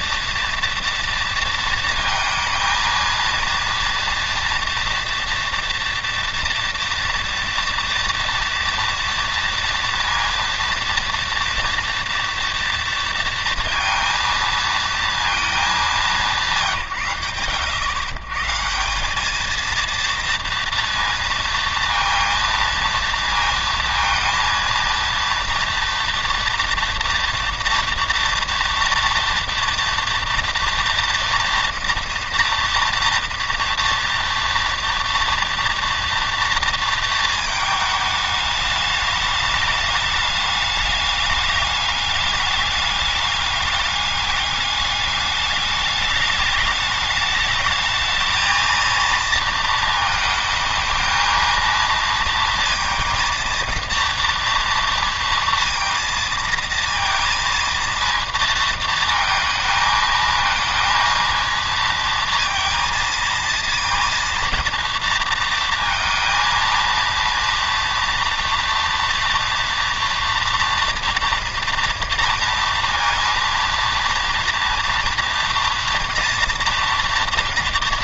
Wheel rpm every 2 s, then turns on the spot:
230, 230, 230, 230, 230, 230, 230, 230, 160, 150, 230, 230, 230, 230, 230, 230, 230, 230, 230, 210, 210, 210, 210, 210, 230, 220, 230, 230, 230, 230, 230, 230, 230, 230, 230, 230, 230, 230, 230.
none